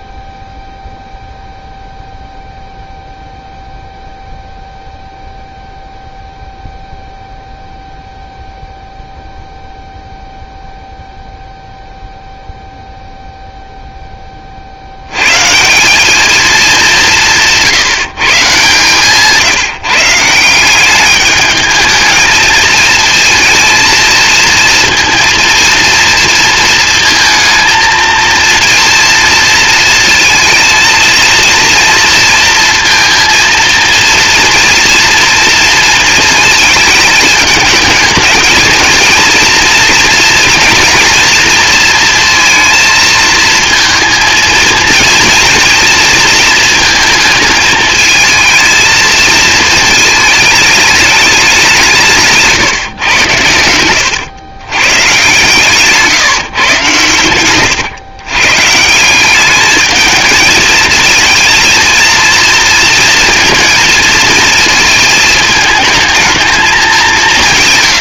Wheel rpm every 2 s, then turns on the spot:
0, 0, 0, 0, 0, 0, 0, 50, 210, 130, 180, 220, 230, 230, 230, 230, 230, 230, 230, 220, 230, 230, 230, 230, 220, 210, 140, 120, 130, 140, 220, 230, 220, 210.
none